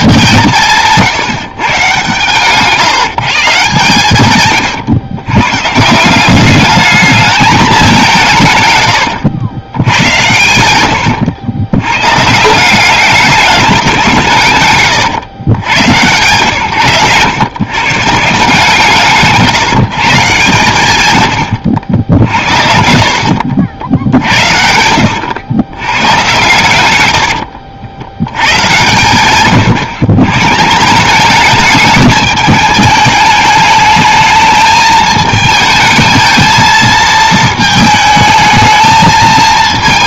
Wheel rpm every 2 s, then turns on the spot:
150, 150, 120, 210, 140, 100, 180, 150, 130, 160, 130, 60, 60, 110, 100, 160, 210, 220, 220, 220.
10-12 14-16 24-26 28-30